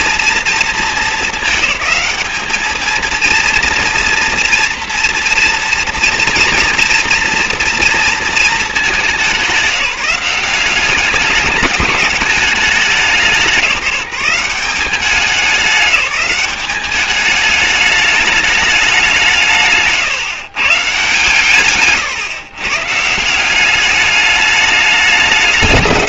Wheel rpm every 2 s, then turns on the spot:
230, 210, 230, 230, 220, 190, 200, 180, 190, 210, 150, 130, 210.
none